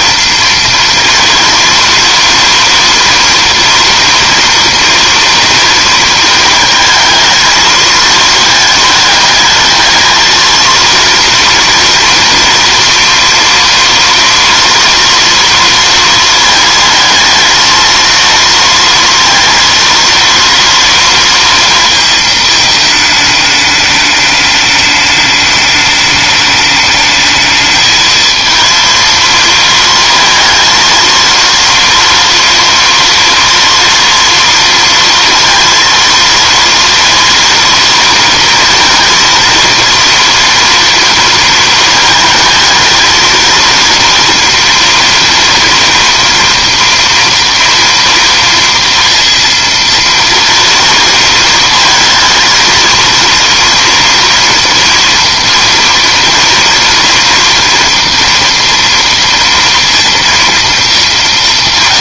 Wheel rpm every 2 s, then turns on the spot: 230, 230, 230, 220, 220, 230, 230, 240, 230, 230, 230, 220, 210, 210, 230, 230, 230, 230, 230, 230, 230, 220, 230, 230, 230, 230, 230, 230, 230, 230, 220.
none